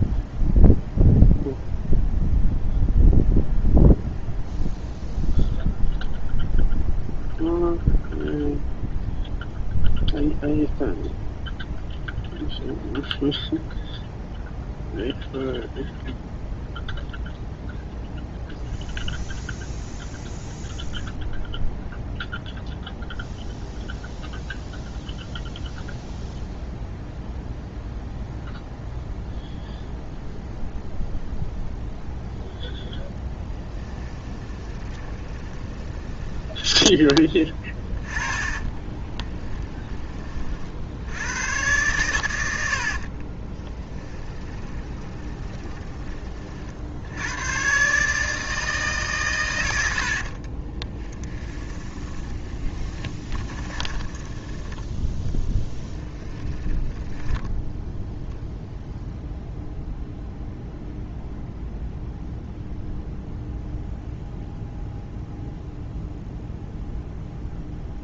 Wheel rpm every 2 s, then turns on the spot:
0, 0, 0, 0, 0, 0, 0, 0, 0, 0, 0, 0, 0, 0, 0, 0, 0, 20, 20, 20, 60, 70, 20, 60, 140, 20, 20, 10, 10, 0, 0, 0, 0, 0.
34-36 38-40 42-46 50-54 56-58